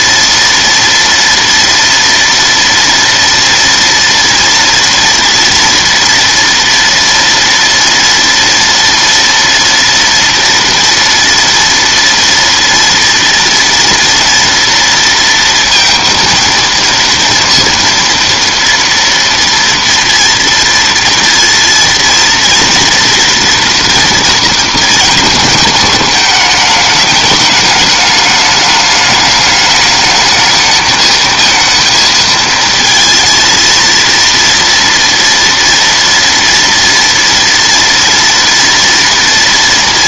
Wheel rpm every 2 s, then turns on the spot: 230, 230, 230, 230, 230, 240, 230, 230, 230, 230, 230, 230, 230, 210, 210, 210, 230, 230, 230, 230.
none